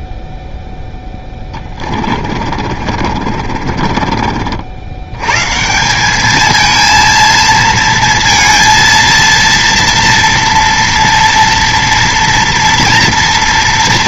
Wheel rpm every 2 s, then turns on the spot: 0, 40, 50, 220, 230, 230, 230.
2-4